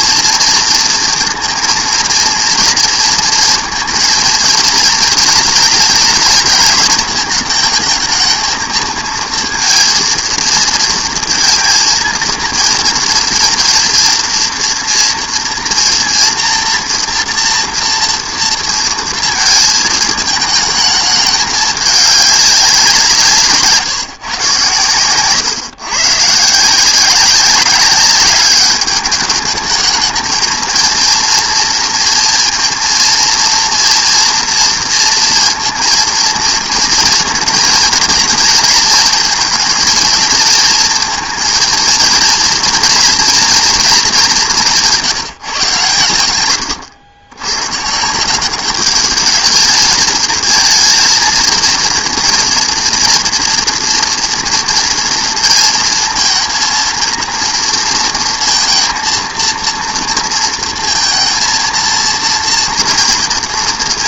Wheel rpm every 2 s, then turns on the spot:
230, 230, 230, 230, 220, 230, 230, 230, 230, 230, 220, 200, 130, 150, 210, 220, 230, 230, 230, 220, 230, 240, 190, 110, 190, 220, 230, 230, 230, 230, 230, 230.
none